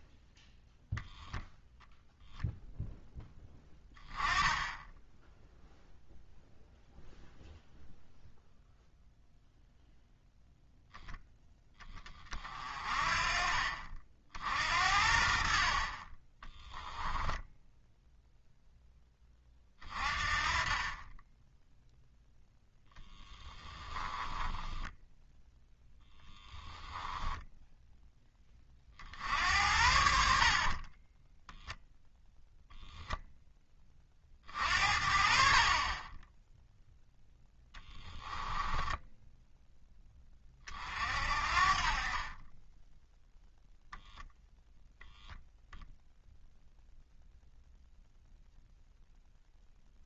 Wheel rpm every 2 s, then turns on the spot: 0, 0, 10, 0, 0, 0, 40, 60, 10, 10, 20, 10, 10, 10, 40, 30, 0, 50, 0, 20, 40, 10, 0, 0, 0.
16-18 24-28 30-32 38-40